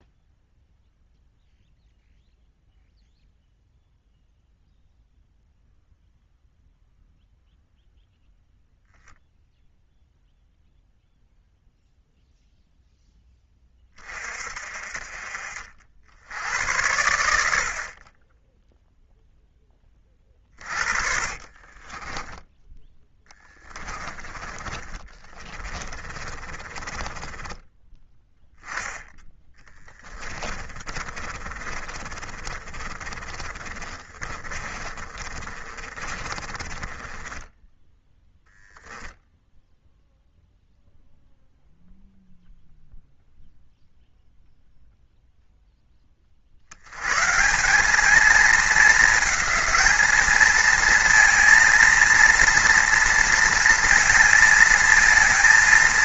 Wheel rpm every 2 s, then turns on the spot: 0, 0, 0, 0, 0, 0, 0, 40, 90, 10, 40, 10, 20, 30, 10, 30, 30, 30, 20, 0, 0, 0, 0, 100, 220, 220, 230, 220.
20-28 30-38